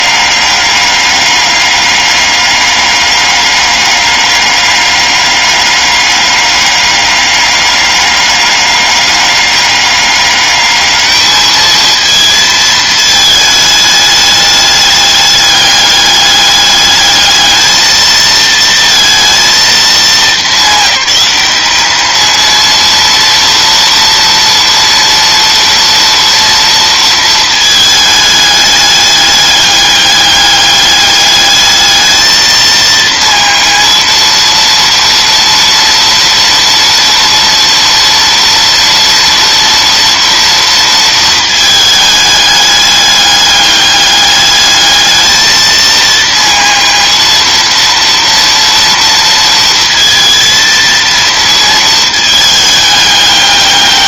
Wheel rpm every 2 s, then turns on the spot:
200, 200, 200, 200, 200, 210, 220, 210, 210, 220, 200, 230, 230, 230, 210, 200, 220, 230, 230, 240, 230, 210, 210, 230, 230, 230, 220.
none